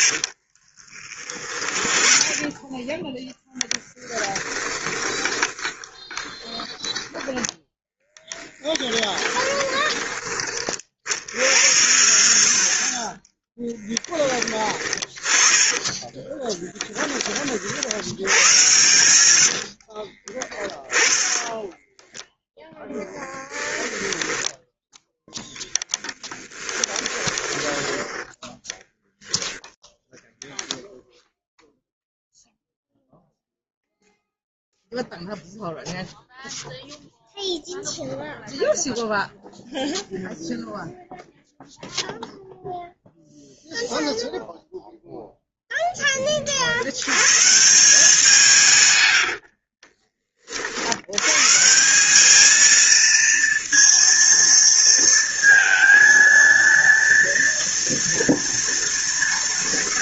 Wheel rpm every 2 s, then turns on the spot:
30, 10, 20, 10, 10, 60, 20, 20, 30, 100, 10, 10, 10, 20, 10, 0, 0, 0, 0, 0, 0, 0, 0, 130, 90, 110, 230, 230, 230, 230.
0-2 4-10 14-16 18-24 26-28 48-50